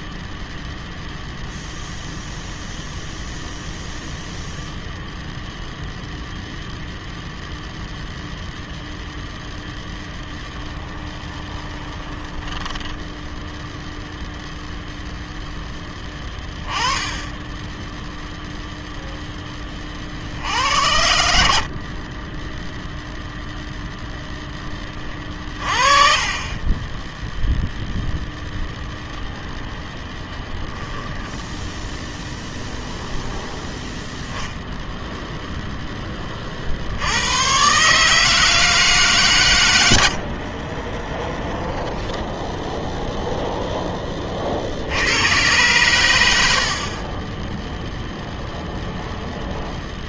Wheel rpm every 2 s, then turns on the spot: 0, 0, 0, 0, 0, 20, 10, 0, 20, 0, 70, 0, 20, 20, 0, 0, 0, 0, 60, 160, 40, 10, 70, 60, 0.
10-14 26-28